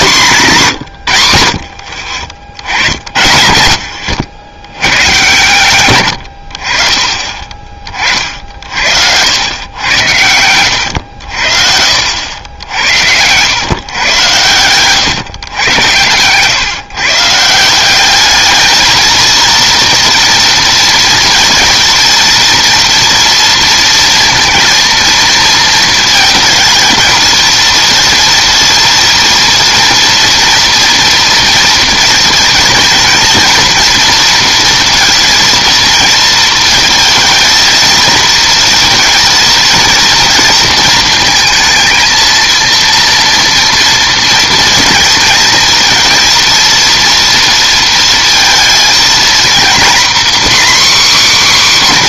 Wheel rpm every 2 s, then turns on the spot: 140, 60, 110, 50, 60, 100, 80, 120, 130, 220, 230, 230, 230, 220, 230, 230, 230, 230, 230, 230, 230, 230, 230, 230, 230, 270.
none